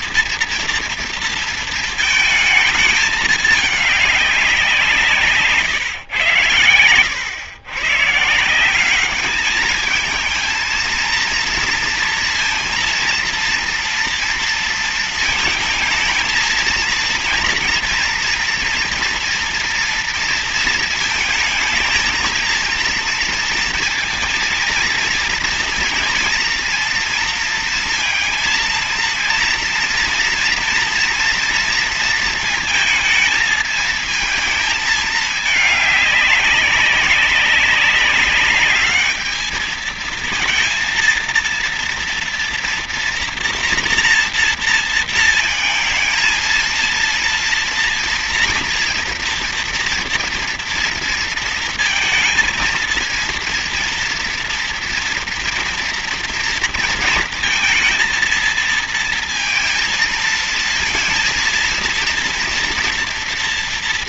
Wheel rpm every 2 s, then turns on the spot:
230, 220, 190, 100, 170, 220, 230, 230, 230, 230, 230, 230, 230, 230, 230, 230, 230, 220, 200, 200, 220, 230, 230, 230, 230, 230, 220, 230, 240, 230, 230, 230.
none